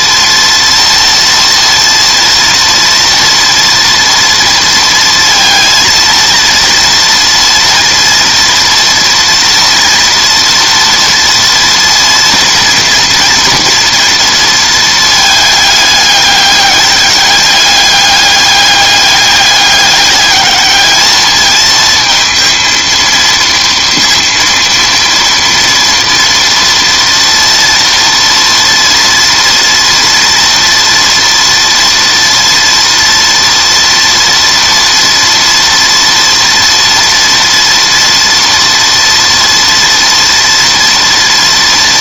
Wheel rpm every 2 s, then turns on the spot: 230, 230, 230, 230, 230, 240, 230, 230, 210, 200, 210, 230, 230, 230, 230, 230, 230, 230, 230, 230, 230.
none